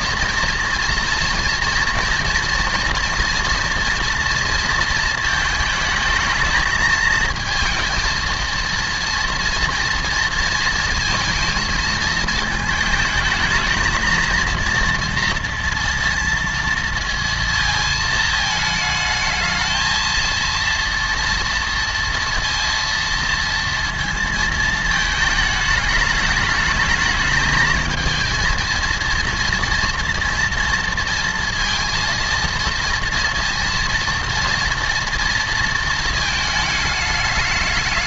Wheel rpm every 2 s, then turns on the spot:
230, 240, 230, 220, 230, 230, 220, 230, 230, 220, 230, 230, 220, 210, 230, 230, 230, 230, 210.
none